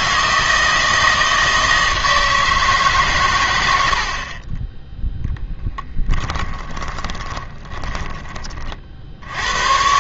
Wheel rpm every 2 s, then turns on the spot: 160, 150, 20, 20, 30.
4-8